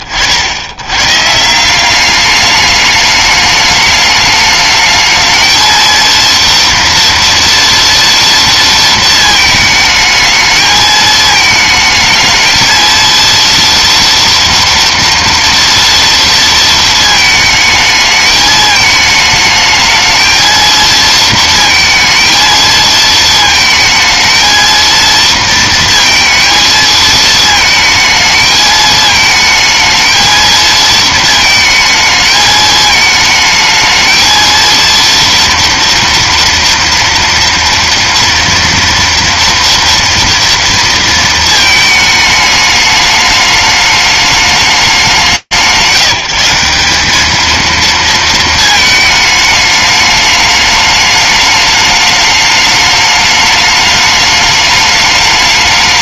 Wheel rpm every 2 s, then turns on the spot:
50, 200, 210, 230, 230, 220, 220, 230, 230, 220, 220, 230, 220, 230, 220, 220, 220, 230, 230, 230, 230, 210, 210, 170, 220, 210, 210, 210.
none